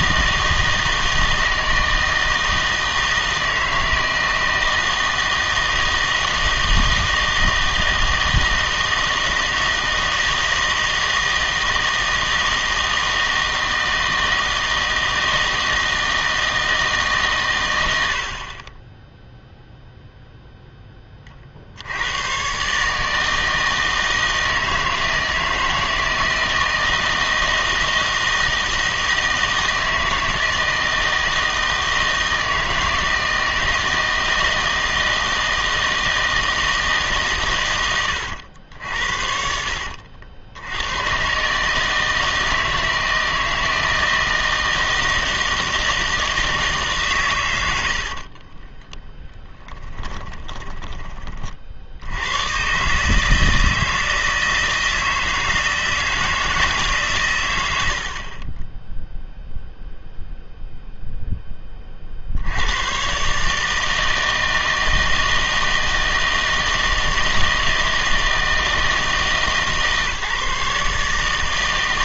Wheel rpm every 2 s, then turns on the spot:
160, 160, 160, 160, 160, 160, 160, 160, 160, 30, 0, 130, 160, 160, 160, 160, 160, 160, 160, 80, 80, 160, 160, 160, 40, 20, 120, 160, 150, 10, 0, 100, 160, 160, 160, 150.
48-52